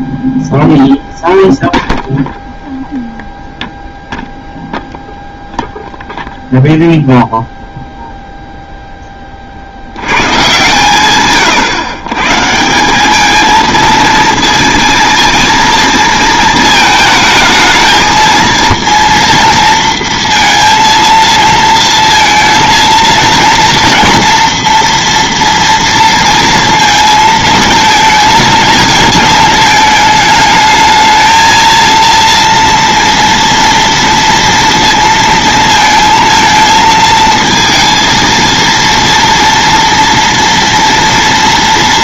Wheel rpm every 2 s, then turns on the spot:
0, 0, 0, 0, 10, 130, 180, 230, 220, 230, 230, 230, 230, 230, 220, 220, 230, 230, 220, 230, 230.
none